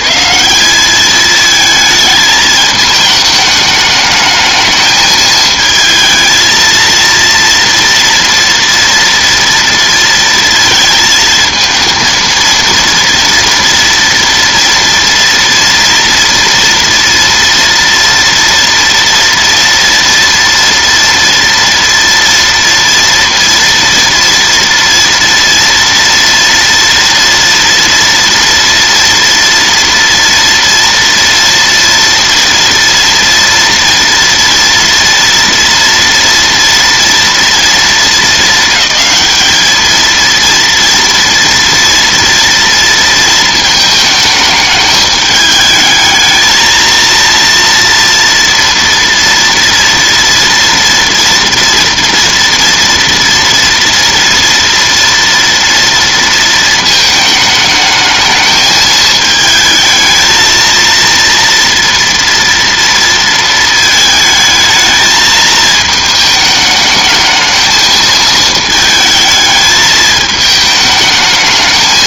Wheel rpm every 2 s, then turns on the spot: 170, 220, 220, 230, 230, 230, 230, 230, 230, 230, 230, 230, 240, 230, 230, 230, 230, 230, 230, 220, 230, 230, 210, 220, 230, 230, 230, 230, 230, 220, 220, 230, 220, 220, 220, 220.
none